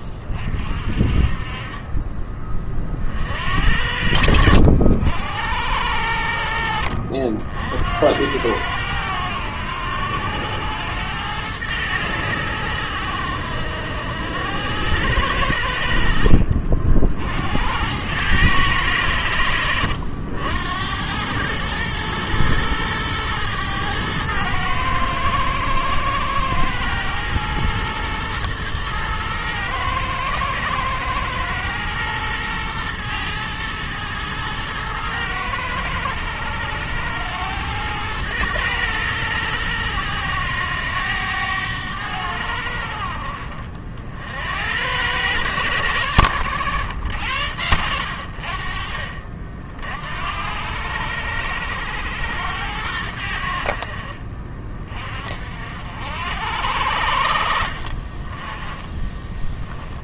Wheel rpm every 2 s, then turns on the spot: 40, 40, 80, 60, 100, 100, 80, 90, 60, 100, 90, 110, 110, 110, 110, 110, 110, 110, 100, 100, 90, 70, 90, 100, 40, 90, 90, 40, 80, 10.
none